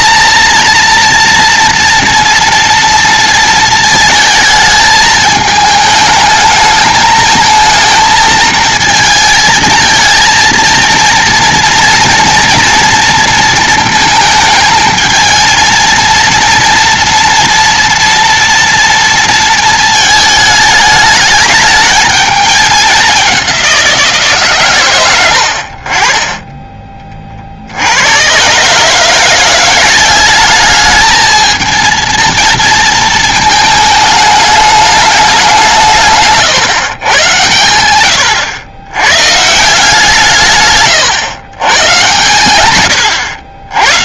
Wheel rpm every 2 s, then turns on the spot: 230, 230, 220, 220, 220, 230, 230, 220, 230, 240, 220, 210, 130, 20, 130, 210, 230, 210, 140, 100, 140, 130.
none